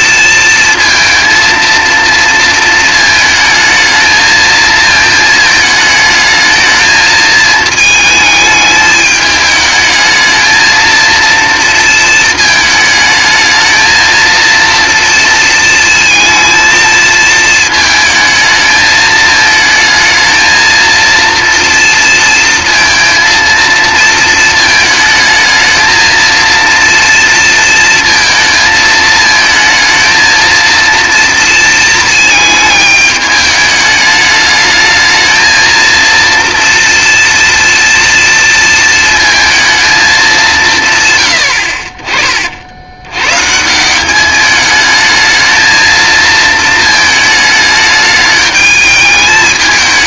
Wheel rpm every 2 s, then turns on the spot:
230, 230, 220, 220, 210, 230, 220, 230, 230, 220, 230, 230, 220, 230, 220, 230, 220, 220, 230, 230, 160, 80, 210, 220, 210.
none